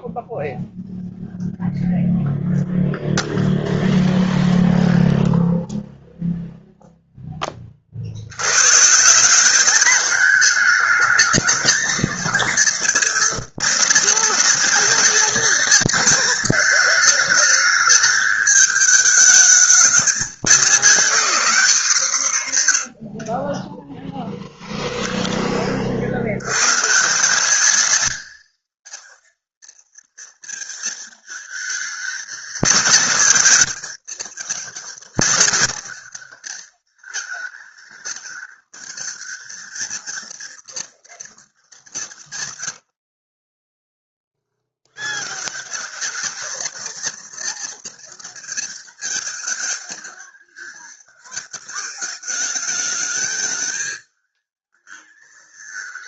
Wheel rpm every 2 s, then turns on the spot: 0, 0, 0, 0, 120, 220, 230, 230, 220, 210, 220, 130, 0, 130, 230, 220, 220, 230, 230, 220, 230, 120, 70, 220, 230, 220, 210, 220.
42-44